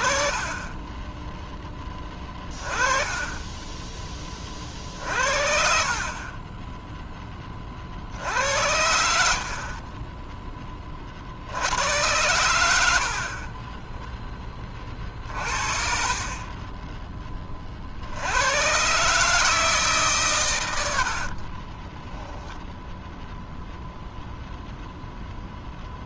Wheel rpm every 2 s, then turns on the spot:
30, 20, 40, 0, 80, 20, 100, 20, 20, 130, 100, 20, 0.
0-2